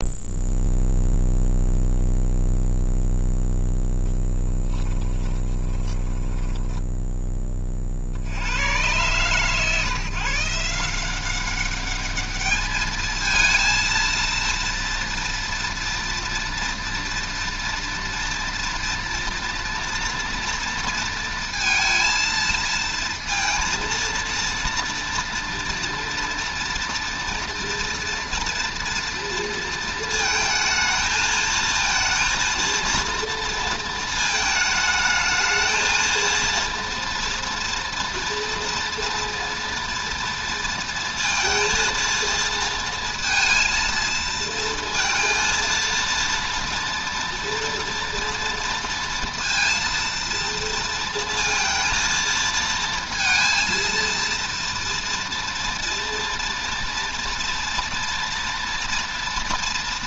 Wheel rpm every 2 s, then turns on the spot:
0, 0, 10, 10, 90, 160, 210, 230, 230, 230, 230, 230, 230, 230, 230, 220, 230, 210, 230, 230, 230, 230, 230, 230, 230, 230, 230, 230, 230, 240.
4-8